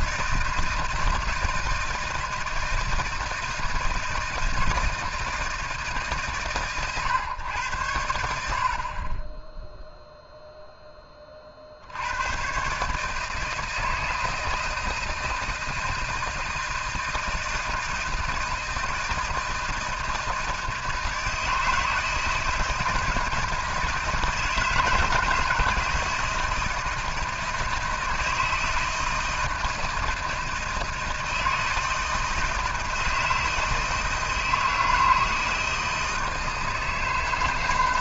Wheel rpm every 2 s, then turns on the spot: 160, 160, 160, 110, 70, 10, 150, 160, 160, 160, 160, 160, 160, 160, 160, 160, 160, 160, 160.
none